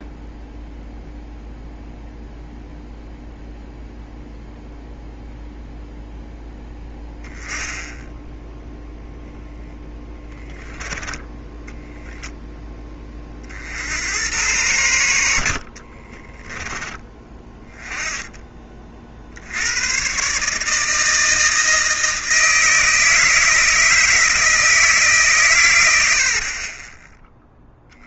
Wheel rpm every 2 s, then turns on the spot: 0, 0, 0, 10, 0, 20, 20, 100, 10, 40, 160, 160, 160, 20.
26-28